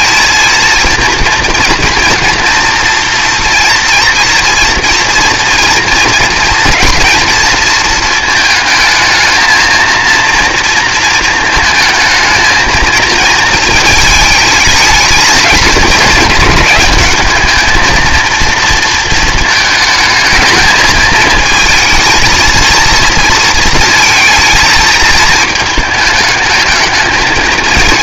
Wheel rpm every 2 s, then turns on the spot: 230, 230, 230, 230, 220, 230, 220, 220, 210, 230, 220, 230, 230, 210.
none